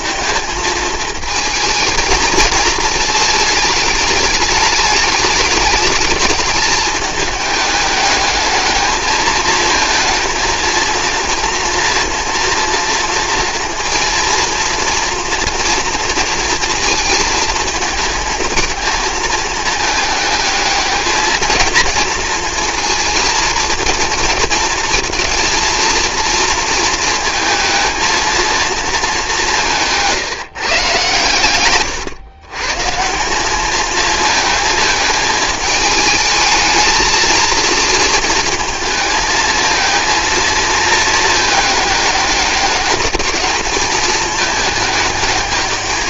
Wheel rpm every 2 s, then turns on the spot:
220, 220, 210, 210, 210, 230, 230, 230, 230, 220, 220, 230, 230, 230, 220, 150, 130, 220, 220, 220, 220, 200, 220.
none